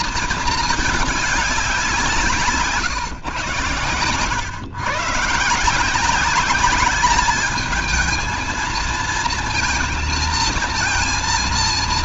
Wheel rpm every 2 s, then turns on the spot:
220, 150, 110, 200, 220, 230.
none